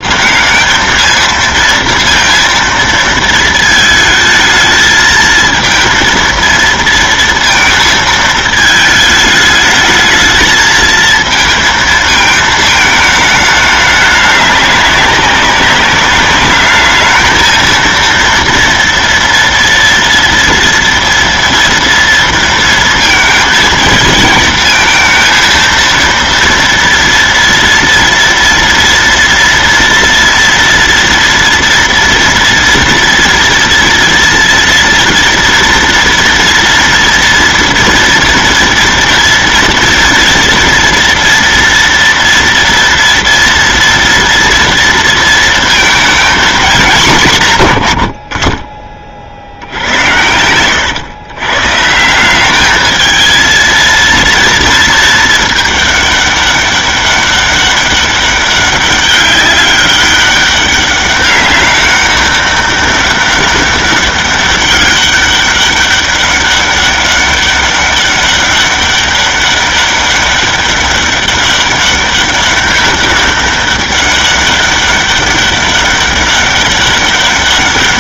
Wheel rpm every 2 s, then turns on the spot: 200, 230, 220, 230, 220, 220, 220, 200, 210, 230, 230, 230, 220, 230, 230, 230, 240, 230, 230, 230, 240, 230, 230, 220, 40, 100, 200, 230, 200, 200, 200, 200, 200, 200, 200, 200, 200, 200, 200.
50-52